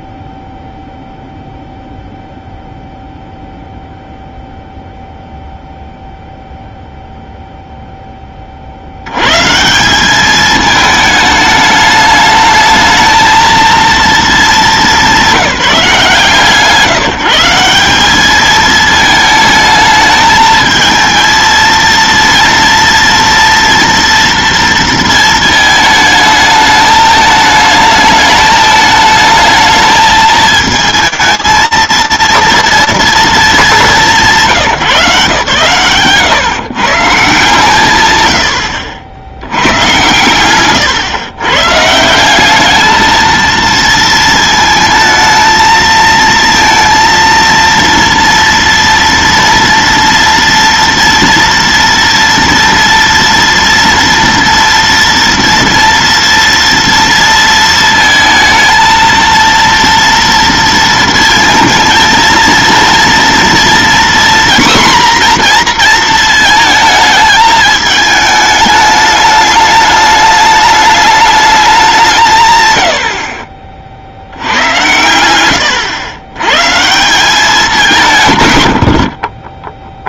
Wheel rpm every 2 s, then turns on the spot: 0, 0, 0, 0, 40, 210, 220, 200, 140, 220, 220, 230, 230, 220, 220, 220, 220, 130, 150, 80, 110, 220, 220, 230, 230, 230, 230, 230, 230, 230, 230, 230, 250, 220, 210, 210, 80, 100, 150, 80.
72-74